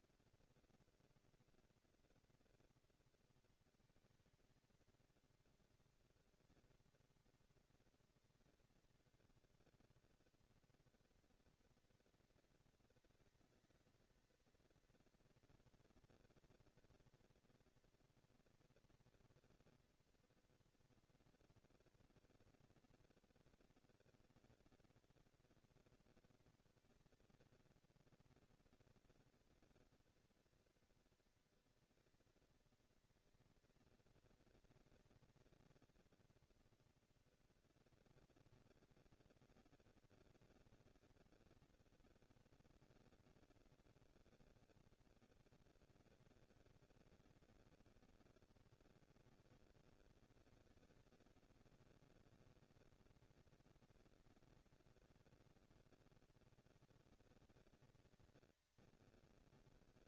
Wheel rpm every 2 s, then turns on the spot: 230, 230, 220, 200, 200, 220, 230, 230, 230, 230, 230, 230, 230, 230, 230, 230, 230, 230, 240, 240, 230, 230, 190, 230, 230, 230, 210, 190, 210, 220.
none